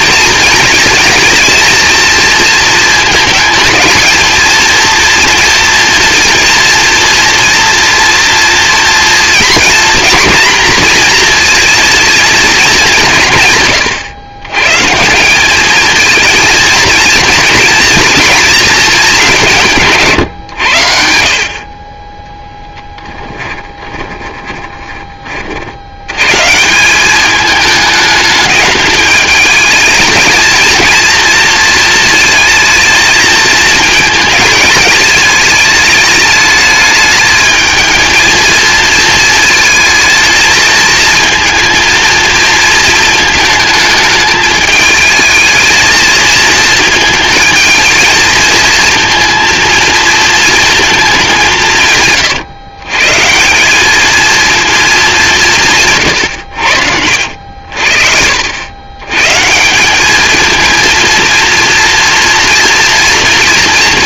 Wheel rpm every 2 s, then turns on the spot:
220, 220, 230, 230, 240, 240, 200, 150, 230, 210, 80, 10, 30, 190, 210, 230, 220, 210, 210, 220, 220, 220, 220, 220, 230, 220, 140, 210, 80, 110, 230, 230.
22-24 56-58